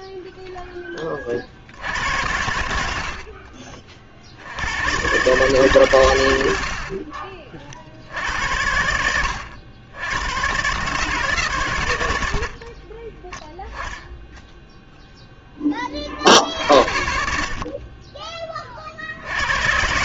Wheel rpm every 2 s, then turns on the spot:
20, 70, 120, 50, 80, 140, 20, 0, 60, 50.
12-14